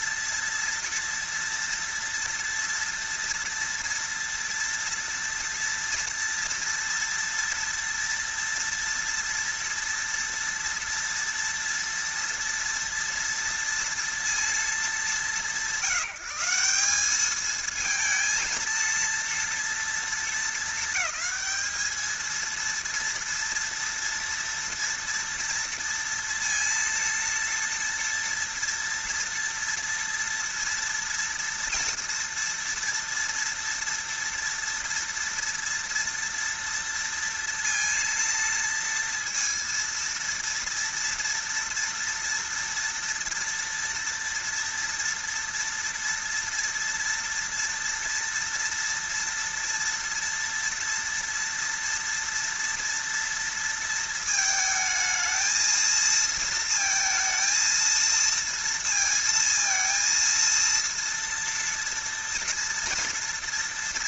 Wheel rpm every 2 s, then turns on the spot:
230, 230, 230, 230, 230, 230, 230, 210, 180, 230, 220, 230, 230, 230, 230, 230, 230, 230, 230, 230, 230, 230, 230, 230, 230, 230, 230, 220, 230, 230, 230, 230.
none